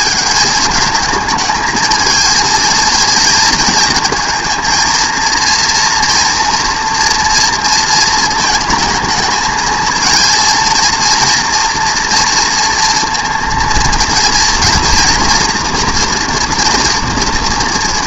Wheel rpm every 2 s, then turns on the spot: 220, 230, 230, 230, 220, 230, 230, 230, 230.
none